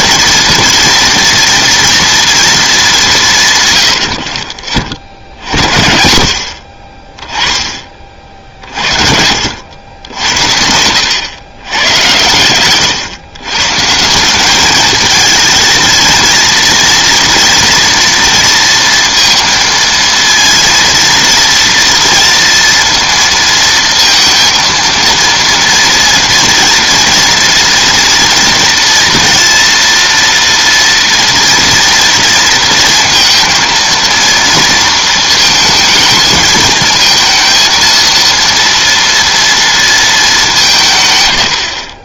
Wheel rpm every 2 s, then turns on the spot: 230, 210, 40, 50, 50, 90, 110, 210, 230, 230, 230, 230, 230, 230, 230, 230, 230, 230, 220, 230, 170.
8-10 12-14